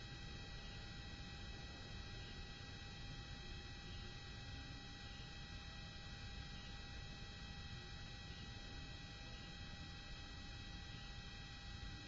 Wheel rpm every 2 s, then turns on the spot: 0, 0, 0, 0, 0, 0.
none